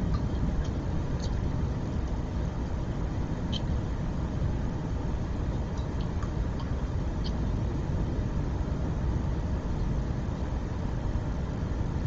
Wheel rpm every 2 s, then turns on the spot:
0, 0, 0, 0, 0, 0.
none